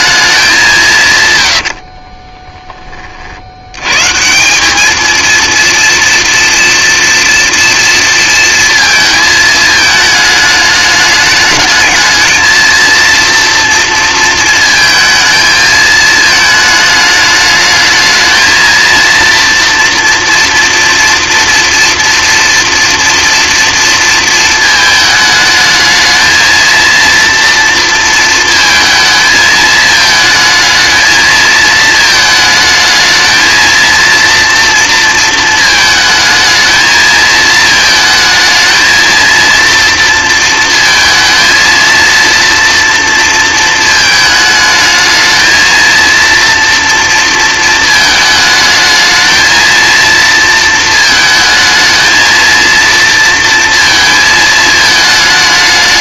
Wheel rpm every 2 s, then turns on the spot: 200, 20, 200, 230, 230, 210, 230, 230, 220, 220, 230, 230, 230, 230, 220, 220, 220, 230, 220, 230, 230, 230, 220, 230, 220, 230, 230, 220.
none